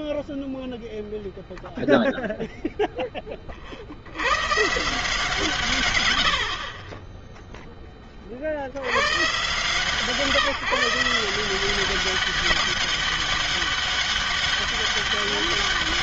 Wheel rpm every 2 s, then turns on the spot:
0, 70, 130, 30, 140, 190, 200, 200.
none